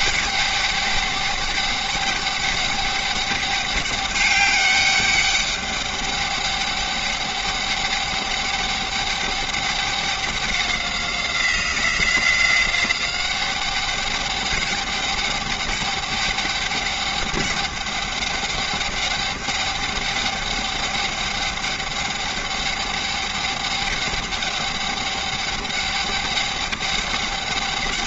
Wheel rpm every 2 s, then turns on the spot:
200, 200, 200, 200, 200, 190, 190, 200, 200, 200, 200, 200, 200, 200.
none